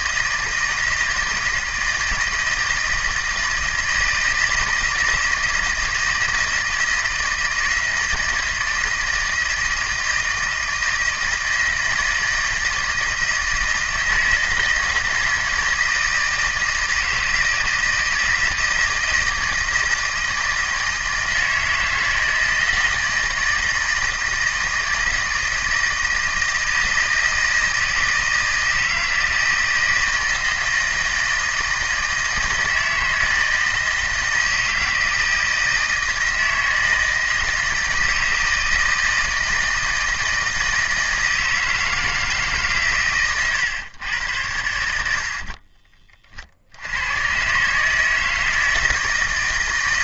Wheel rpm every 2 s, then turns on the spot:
160, 160, 160, 160, 160, 160, 160, 160, 160, 160, 160, 160, 160, 160, 160, 160, 160, 160, 160, 160, 160, 140, 80, 70, 160.
none